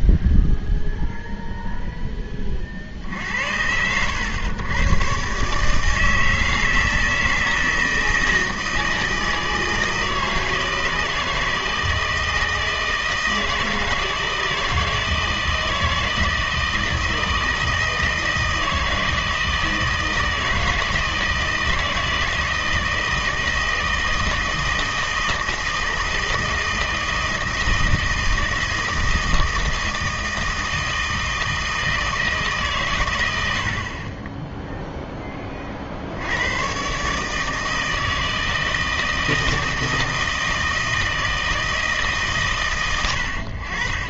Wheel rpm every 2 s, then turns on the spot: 0, 40, 120, 160, 160, 160, 160, 160, 160, 160, 160, 160, 160, 160, 160, 160, 140, 10, 130, 160, 160, 120.
none